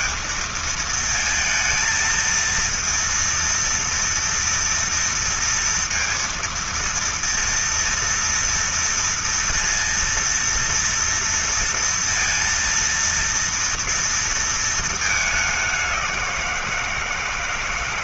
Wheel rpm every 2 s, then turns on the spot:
220, 230, 230, 230, 230, 230, 230, 220, 160.
none